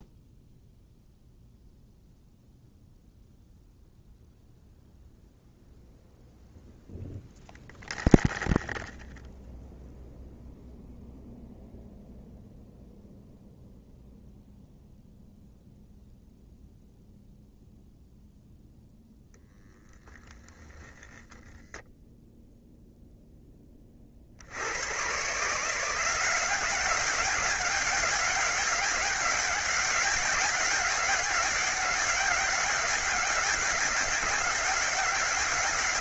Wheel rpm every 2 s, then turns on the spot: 0, 0, 0, 0, 0, 0, 0, 0, 0, 0, 10, 0, 100, 190, 200, 200, 200, 180.
none